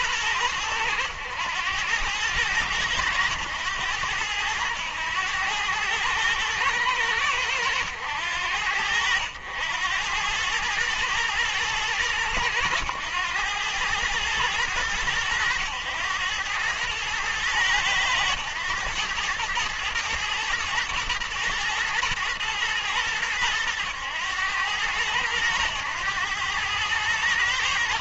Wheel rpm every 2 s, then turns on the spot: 100, 100, 100, 100, 80, 110, 100, 110, 110, 110, 110, 110, 100, 100.
none